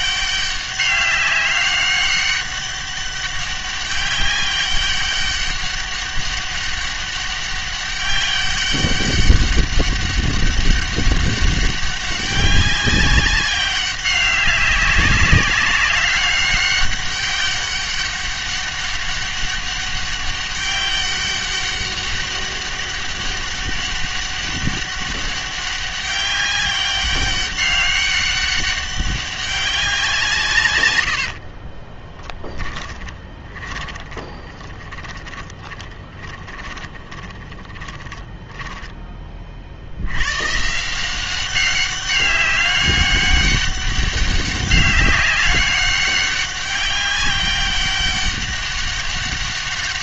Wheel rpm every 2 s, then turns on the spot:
200, 200, 200, 200, 200, 200, 200, 200, 200, 200, 200, 200, 200, 200, 200, 130, 10, 20, 20, 10, 140, 200, 200, 200, 200.
32-40